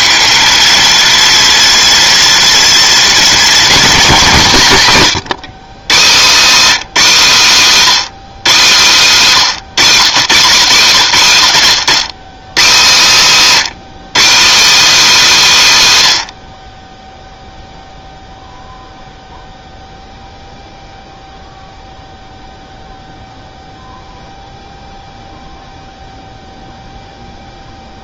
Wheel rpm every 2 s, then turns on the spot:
230, 240, 170, 230, 200, 150, 160, 270, 40, 0, 0, 0, 0, 0.
none